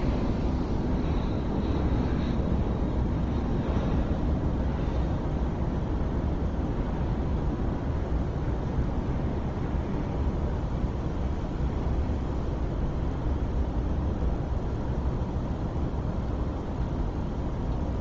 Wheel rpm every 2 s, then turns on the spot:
0, 0, 0, 0, 0, 0, 0, 0, 0.
none